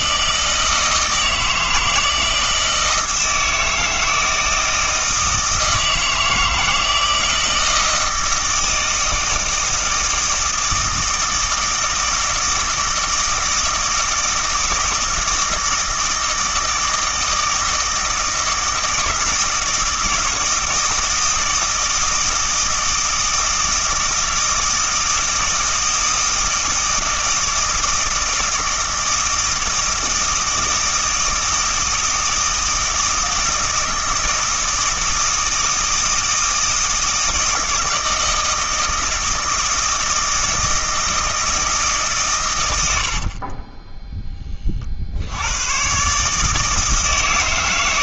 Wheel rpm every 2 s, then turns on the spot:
160, 160, 160, 160, 160, 160, 160, 160, 160, 160, 160, 160, 160, 160, 160, 160, 160, 160, 160, 160, 160, 100, 40, 160.
none